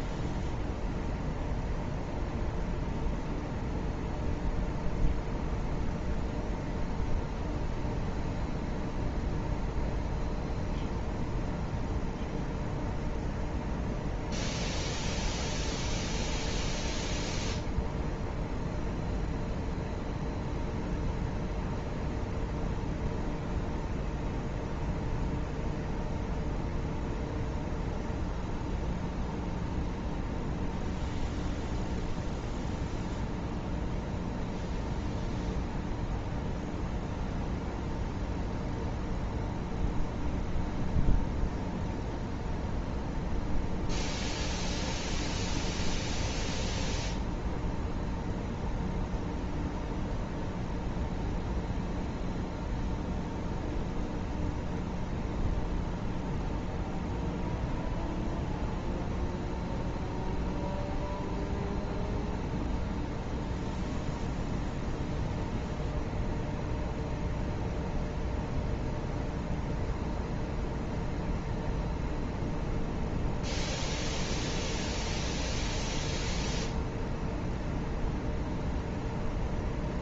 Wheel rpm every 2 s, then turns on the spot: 0, 0, 0, 0, 0, 0, 0, 0, 0, 0, 0, 0, 0, 0, 0, 0, 0, 0, 0, 0, 0, 0, 0, 0, 0, 0, 0, 0, 0, 0, 0, 0, 0, 0, 0, 0, 0, 0, 0, 0.
none